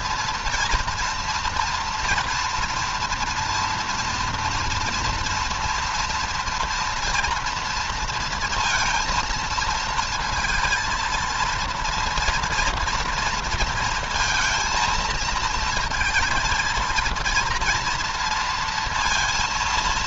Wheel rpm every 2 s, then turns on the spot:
230, 230, 230, 230, 230, 220, 230, 230, 230, 230.
none